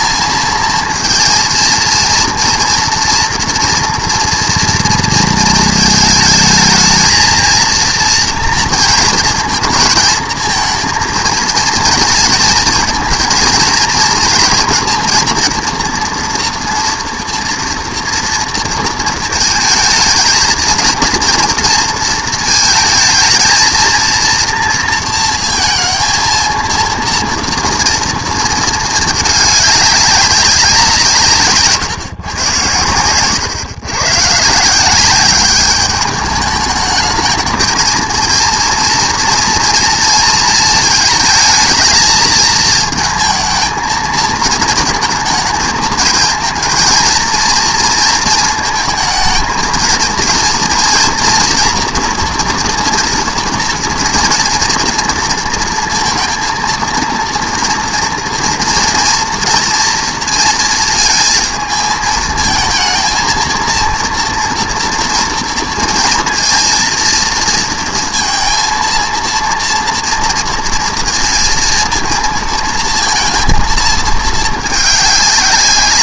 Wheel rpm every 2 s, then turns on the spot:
230, 230, 230, 220, 230, 230, 230, 230, 240, 230, 220, 220, 230, 230, 220, 180, 110, 150, 210, 230, 220, 220, 230, 230, 220, 230, 230, 230, 230, 230, 230, 230, 230, 230, 230, 230, 230, 210.
none